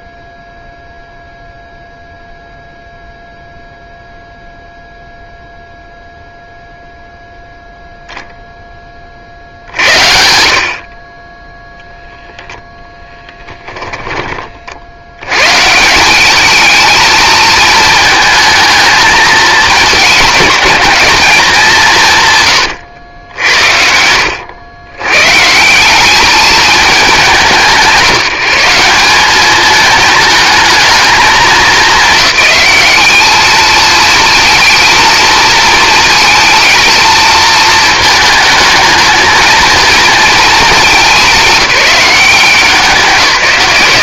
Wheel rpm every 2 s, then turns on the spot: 0, 0, 0, 0, 30, 60, 10, 70, 220, 220, 220, 100, 120, 210, 170, 220, 200, 230, 220, 220, 210, 170.
none